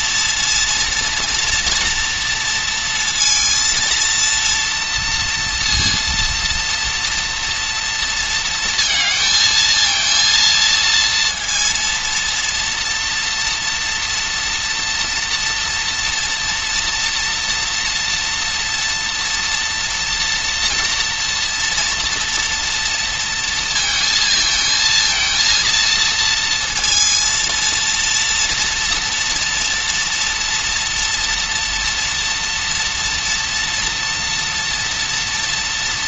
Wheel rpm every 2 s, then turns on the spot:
230, 230, 230, 230, 230, 230, 230, 240, 240, 230, 230, 230, 230, 230, 230, 230, 230, 230.
none